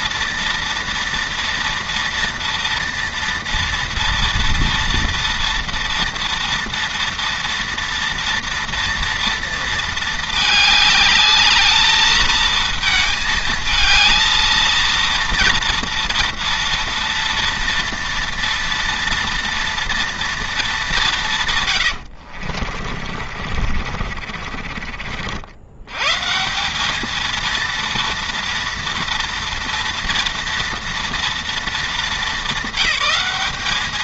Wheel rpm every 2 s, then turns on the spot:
230, 230, 230, 230, 240, 210, 220, 230, 230, 240, 190, 50, 40, 200, 230, 230, 190.
22-26